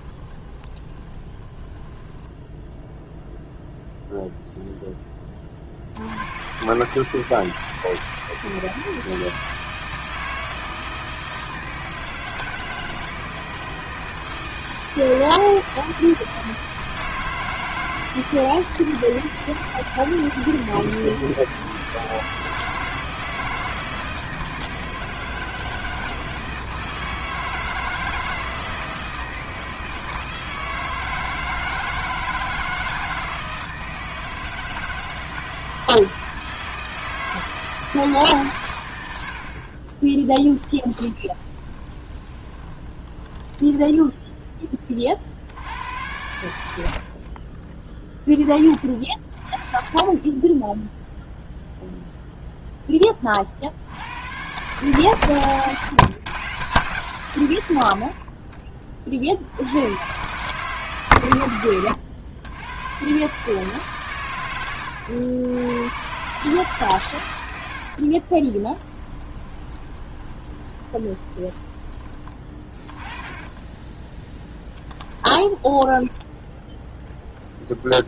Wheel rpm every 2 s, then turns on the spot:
20, 0, 0, 120, 160, 160, 160, 160, 160, 160, 160, 160, 160, 160, 160, 160, 160, 160, 160, 130, 20, 30, 20, 70, 20, 10, 0, 120, 140, 30, 140, 110, 100, 140, 30, 20, 20, 20, 10.
0-2 40-44 68-72 74-76